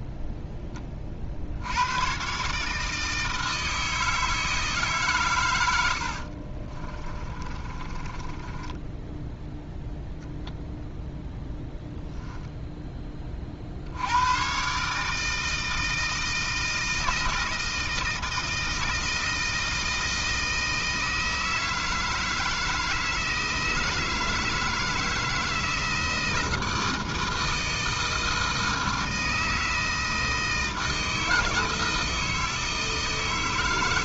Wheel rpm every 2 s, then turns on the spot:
30, 150, 150, 30, 10, 0, 0, 140, 160, 160, 160, 160, 160, 160, 160, 160, 160.
6-10